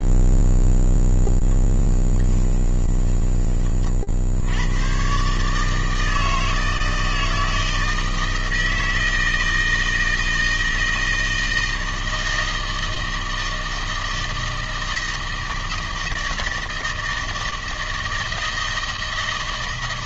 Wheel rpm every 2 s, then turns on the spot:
0, 10, 100, 160, 160, 160, 160, 160, 160, 160.
2-4